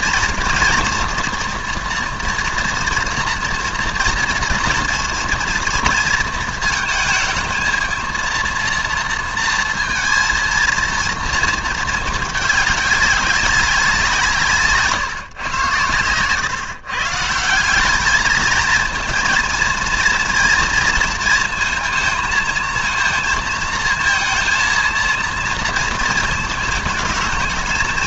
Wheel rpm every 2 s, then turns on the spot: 230, 230, 230, 230, 230, 230, 210, 160, 130, 220, 220, 220, 230, 220.
none